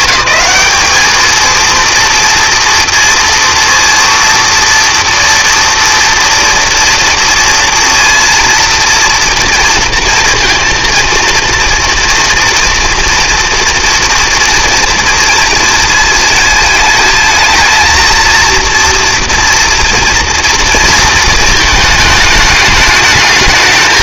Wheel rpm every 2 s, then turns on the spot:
210, 230, 230, 230, 230, 230, 240, 230, 220, 230, 230, 210.
none